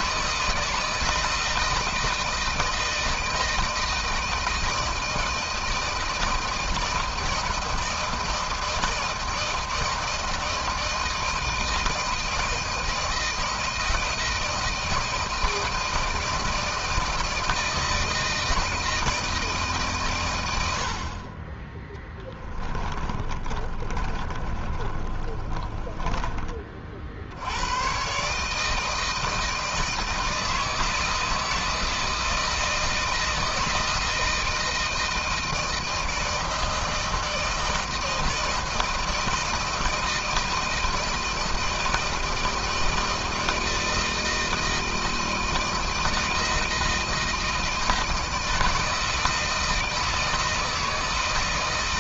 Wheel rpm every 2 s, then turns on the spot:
160, 160, 160, 160, 170, 160, 160, 160, 160, 160, 110, 20, 30, 30, 140, 160, 160, 160, 160, 160, 160, 160, 160, 160, 160, 160.
22-26